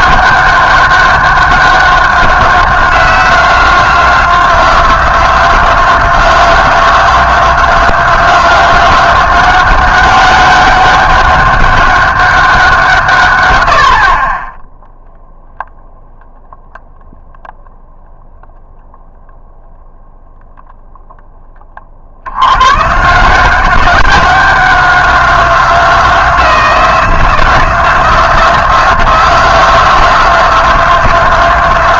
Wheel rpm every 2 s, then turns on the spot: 200, 190, 180, 180, 180, 190, 180, 20, 0, 0, 0, 110, 190, 170, 180, 180.
none